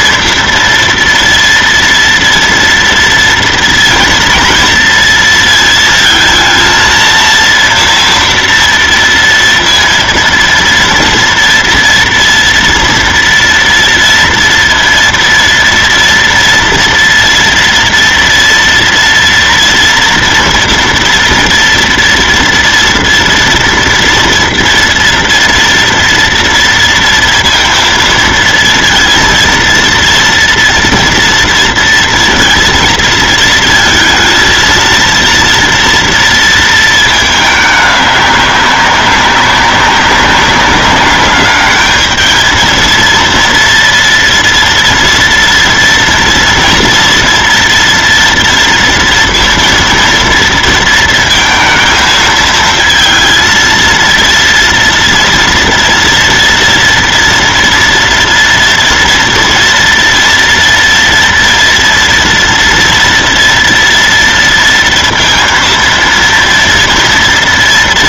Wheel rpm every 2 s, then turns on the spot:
230, 230, 230, 230, 230, 230, 230, 230, 230, 230, 240, 230, 230, 230, 230, 230, 230, 230, 220, 200, 190, 220, 230, 230, 230, 230, 230, 230, 240, 240, 230, 240, 230, 230.
none